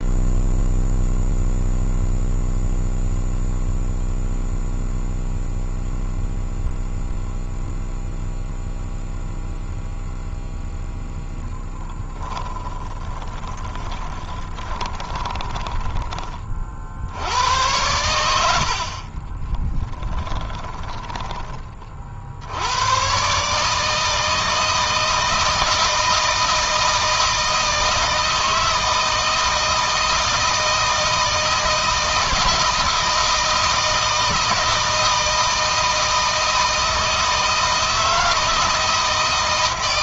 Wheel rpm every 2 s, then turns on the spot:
0, 0, 0, 0, 0, 10, 30, 30, 100, 10, 30, 150, 160, 160, 160, 160, 160, 160, 170, 160.
10-20